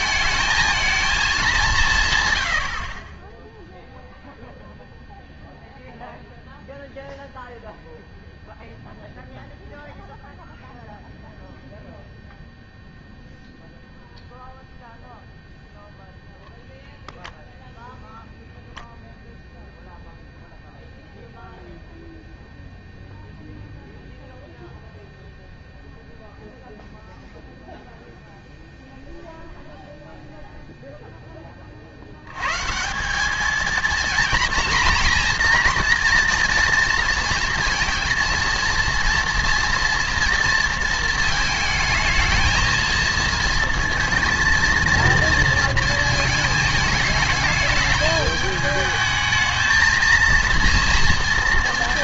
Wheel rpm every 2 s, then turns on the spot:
220, 80, 0, 0, 0, 0, 0, 0, 0, 0, 0, 0, 0, 0, 0, 0, 150, 230, 230, 230, 230, 220, 230, 220, 220, 230.
2-4